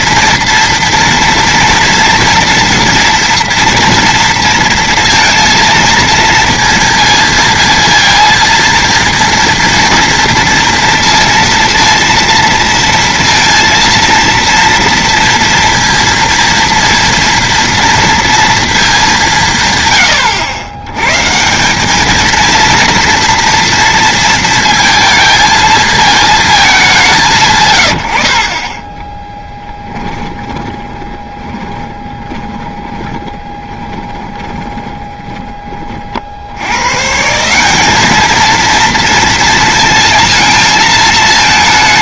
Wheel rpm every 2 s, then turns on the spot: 240, 230, 230, 230, 230, 230, 230, 230, 230, 220, 90, 230, 230, 220, 40, 20, 20, 20, 100, 230, 220.
28-36